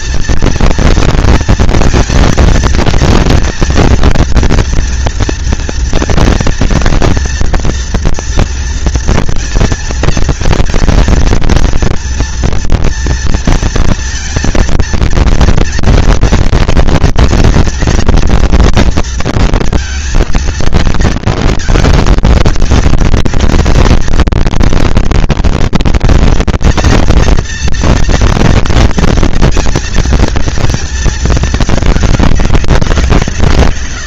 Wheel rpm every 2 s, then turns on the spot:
230, 230, 230, 230, 240, 230, 230, 230, 240, 230, 230, 230, 230, 230, 230, 230, 200.
none